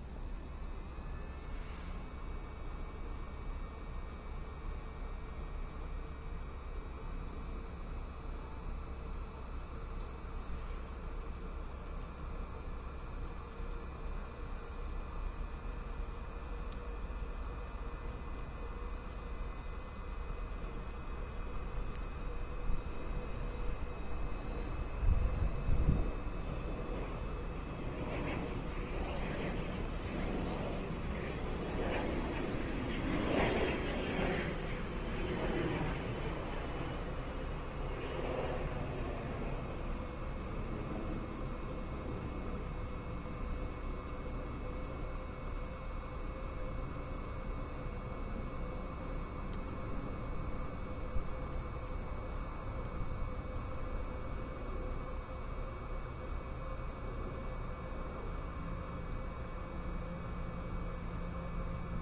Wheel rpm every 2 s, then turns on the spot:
0, 0, 0, 0, 0, 0, 0, 0, 0, 0, 0, 0, 0, 0, 0, 0, 0, 0, 0, 0, 0, 0, 0, 0, 0, 0, 0, 0, 0, 0, 0.
none